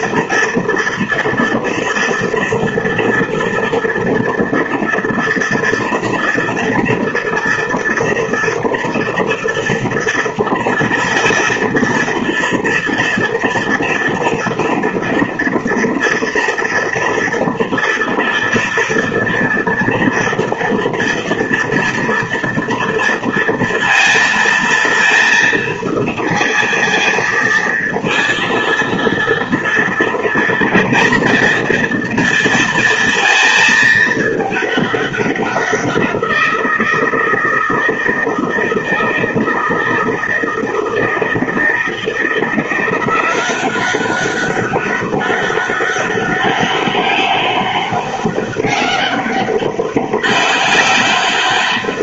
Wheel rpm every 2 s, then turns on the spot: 230, 230, 230, 230, 230, 230, 230, 230, 230, 230, 230, 230, 230, 230, 230, 230, 230, 210, 170, 160, 160, 170, 190, 200, 200, 200.
none